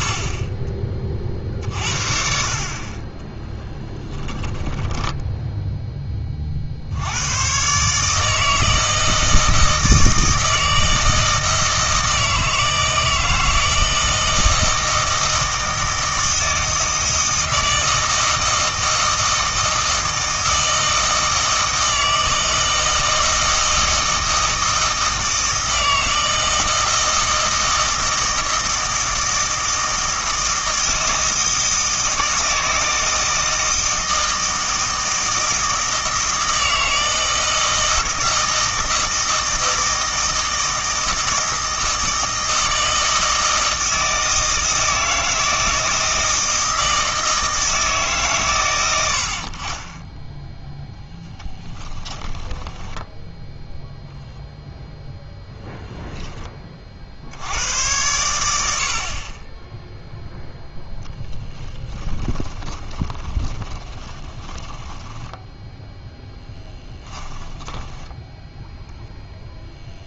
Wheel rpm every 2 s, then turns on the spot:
20, 50, 20, 50, 160, 160, 160, 160, 160, 160, 160, 160, 160, 160, 160, 160, 160, 160, 160, 160, 160, 160, 160, 160, 110, 10, 10, 0, 30, 80, 0, 20, 10, 20, 0.
4-6 52-54 62-68